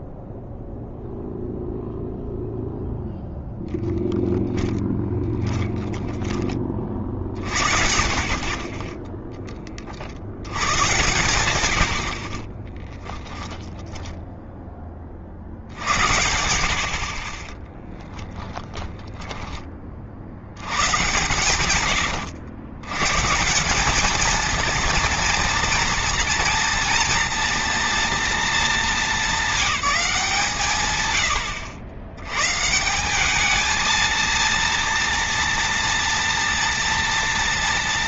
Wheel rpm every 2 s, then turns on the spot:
0, 0, 10, 50, 10, 120, 10, 30, 30, 20, 100, 140, 230, 230, 210, 120, 190, 230, 230.
4-6 12-14 18-20